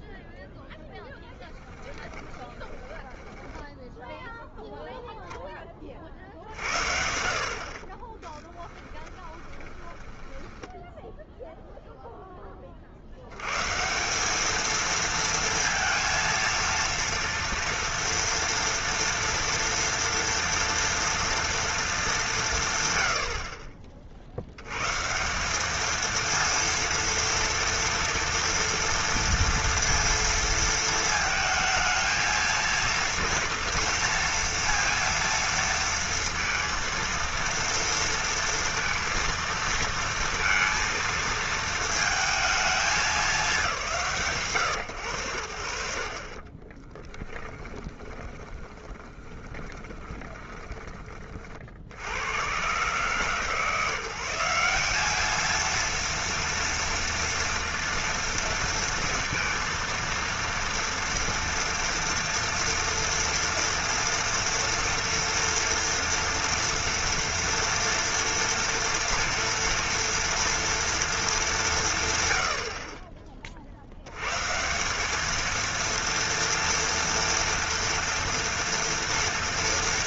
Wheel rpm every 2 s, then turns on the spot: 0, 20, 0, 60, 10, 10, 30, 220, 230, 230, 230, 150, 110, 230, 230, 230, 230, 230, 230, 230, 230, 200, 120, 20, 20, 20, 130, 190, 230, 230, 230, 230, 230, 240, 240, 230, 60, 170, 230, 240.
2-4 8-12 46-50